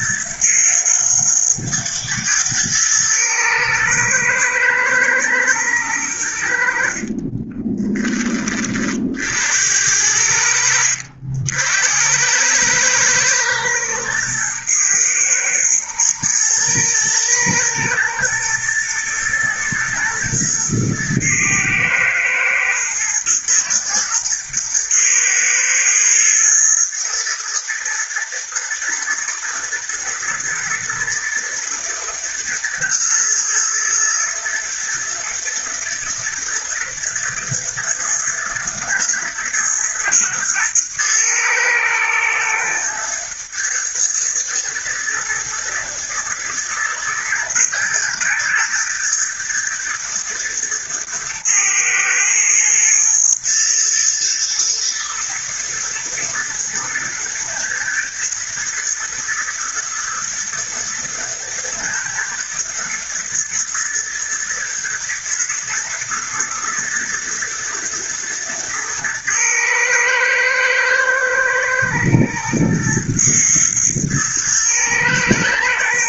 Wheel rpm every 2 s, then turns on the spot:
110, 110, 120, 70, 40, 70, 110, 110, 110, 110, 120, 110, 110, 110, 110, 110, 110, 110, 120, 110, 110, 110, 110, 110, 120, 110, 120, 120, 110, 110, 110, 120, 120, 110, 110, 110, 120, 110.
6-8